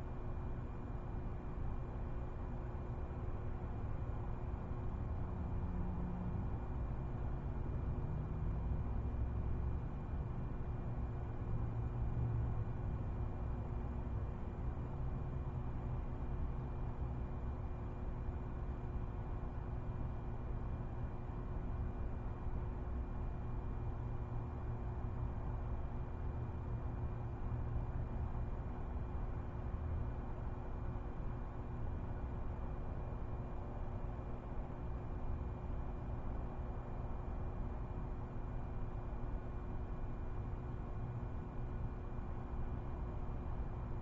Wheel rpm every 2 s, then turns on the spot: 0, 0, 0, 0, 0, 0, 0, 0, 0, 0, 0, 0, 0, 0, 0, 0, 0, 0, 0, 0, 0, 0.
none